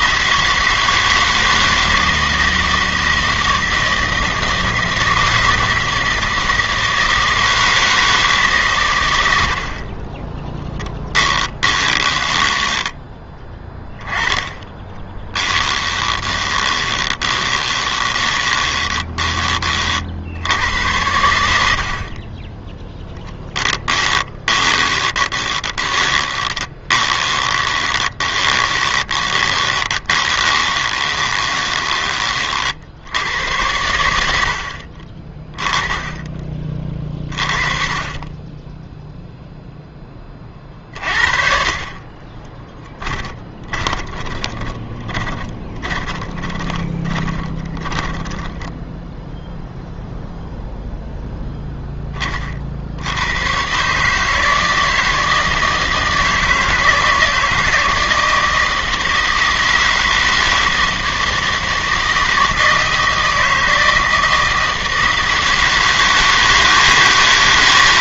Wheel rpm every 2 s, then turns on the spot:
160, 160, 160, 160, 140, 10, 10, 20, 20, 20, 90, 10, 20, 20, 20, 20, 40, 60, 30, 10, 40, 20, 20, 20, 10, 0, 50, 160, 160, 160, 160, 160, 160, 160.
12-14 16-20 24-32 42-50